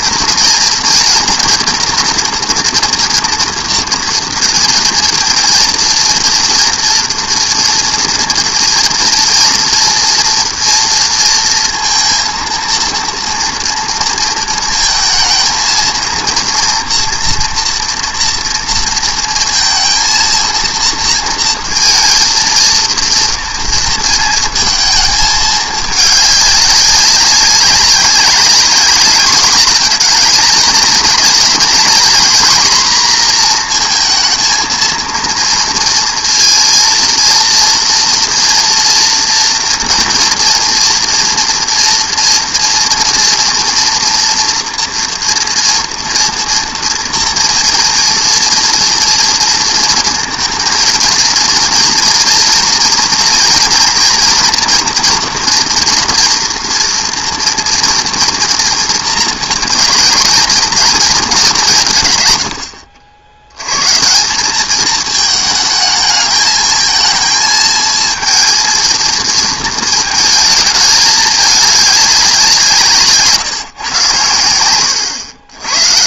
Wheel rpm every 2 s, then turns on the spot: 230, 230, 230, 230, 230, 230, 230, 230, 230, 230, 230, 230, 220, 200, 200, 230, 250, 230, 230, 240, 230, 240, 240, 230, 230, 230, 230, 240, 240, 240, 230, 100, 200, 220, 230, 220, 180, 100.
none